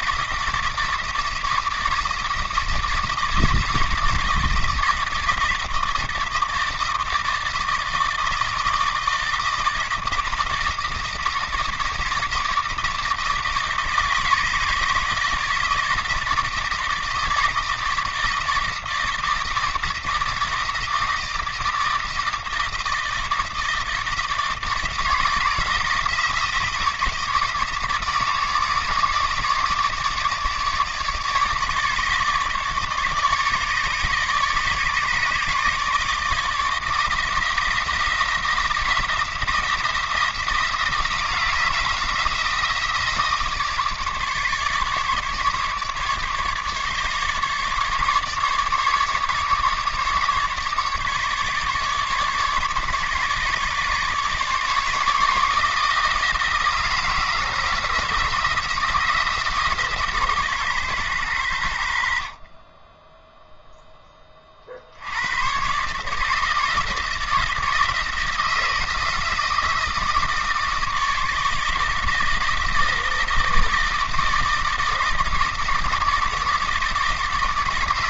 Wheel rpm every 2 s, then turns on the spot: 160, 160, 160, 160, 160, 160, 160, 160, 160, 160, 160, 160, 160, 160, 150, 150, 150, 150, 160, 170, 170, 170, 150, 150, 150, 150, 140, 150, 160, 160, 130, 20, 60, 160, 160, 160, 160, 160, 160.
none